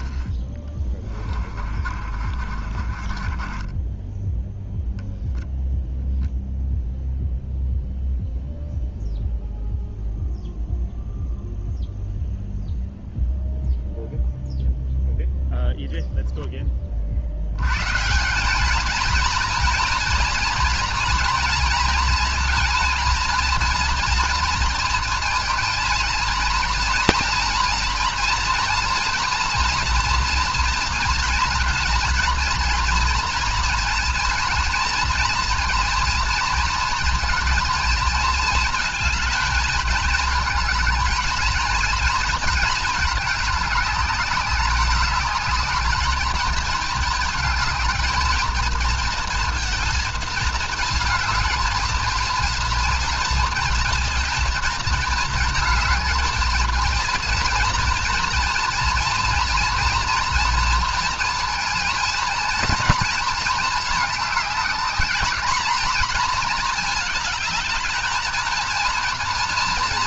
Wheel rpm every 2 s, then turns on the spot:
10, 40, 10, 0, 0, 0, 0, 0, 20, 210, 240, 230, 230, 230, 230, 230, 230, 230, 230, 220, 220, 220, 200, 220, 230, 220, 230, 230, 230, 230, 240, 230, 210, 230, 230.
0-4